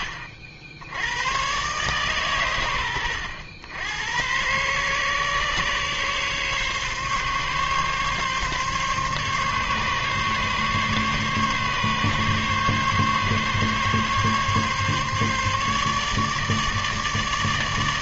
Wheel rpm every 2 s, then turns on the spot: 70, 110, 120, 140, 140, 140, 140, 140, 150.
none